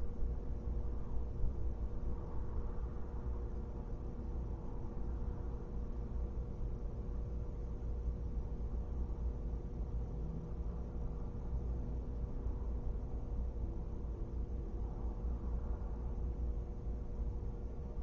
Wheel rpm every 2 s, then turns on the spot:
0, 0, 0, 0, 0, 0, 0, 0, 0.
none